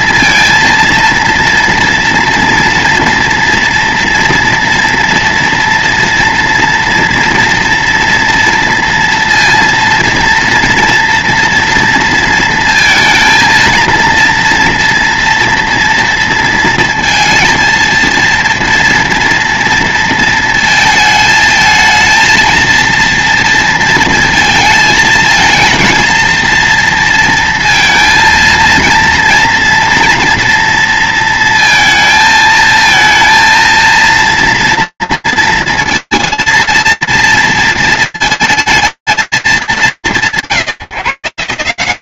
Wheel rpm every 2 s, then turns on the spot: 230, 230, 230, 230, 230, 230, 230, 230, 230, 230, 220, 230, 230, 230, 230, 230, 220, 230, 230, 190, 140.
none